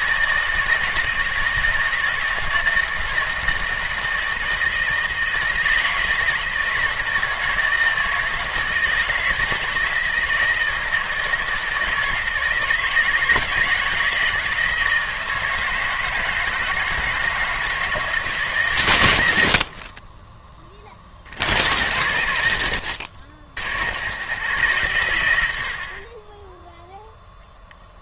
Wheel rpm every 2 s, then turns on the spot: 160, 160, 160, 160, 160, 160, 160, 160, 160, 130, 30, 70, 110, 10.
none